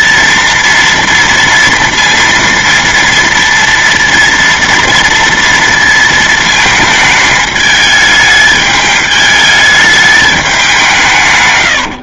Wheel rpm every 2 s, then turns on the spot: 230, 230, 230, 220, 210, 190.
none